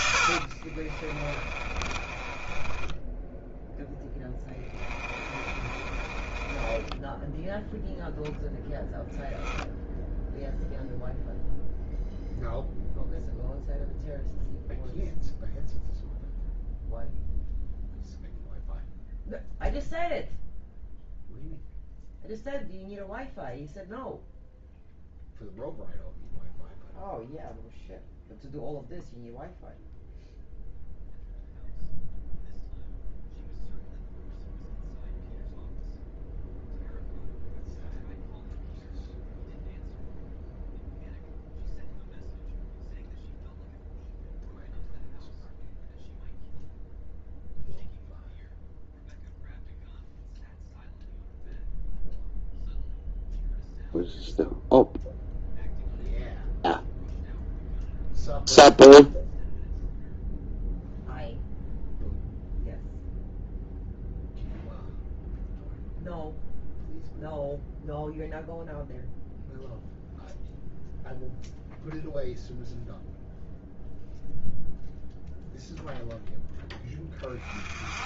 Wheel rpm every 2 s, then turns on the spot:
60, 20, 10, 20, 0, 0, 0, 0, 0, 0, 0, 0, 0, 0, 0, 0, 0, 0, 0, 0, 0, 0, 0, 0, 0, 0, 0, 0, 0, 0, 0, 0, 0, 0, 0, 0, 0, 0, 10.
0-8